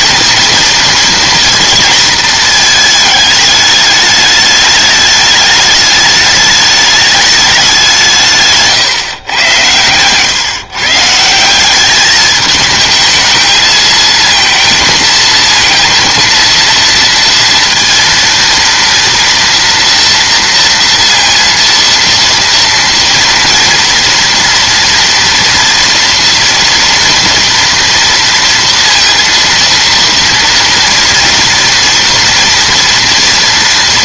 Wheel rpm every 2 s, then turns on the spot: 230, 220, 210, 210, 140, 140, 220, 230, 230, 230, 230, 230, 230, 230, 230, 230, 230.
none